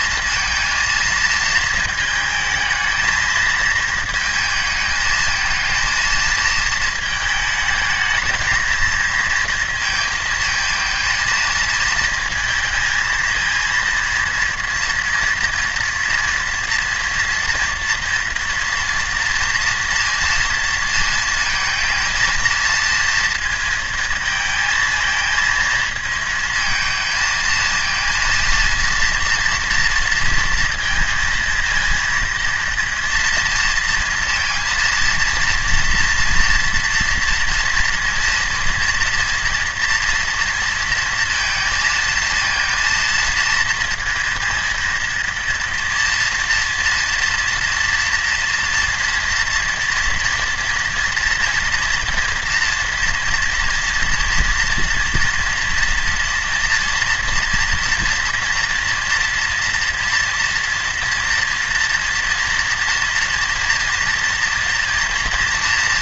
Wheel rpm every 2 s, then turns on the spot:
230, 220, 220, 220, 220, 220, 220, 230, 230, 230, 230, 230, 220, 220, 230, 230, 230, 230, 240, 230, 230, 230, 230, 230, 230, 230, 230, 230, 230, 230, 230, 230, 230.
none